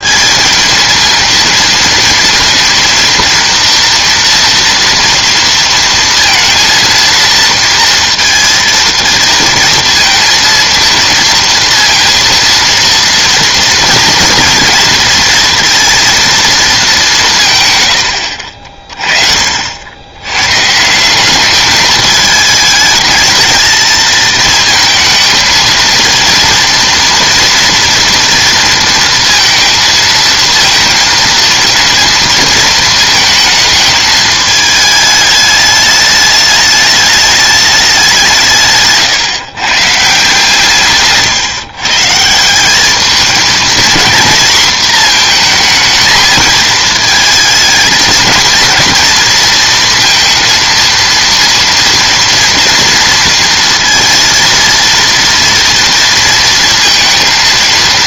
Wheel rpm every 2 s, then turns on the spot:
220, 230, 230, 230, 230, 230, 230, 230, 220, 60, 130, 210, 220, 230, 230, 230, 220, 220, 210, 160, 160, 180, 230, 220, 230, 230, 230, 230, 230.
none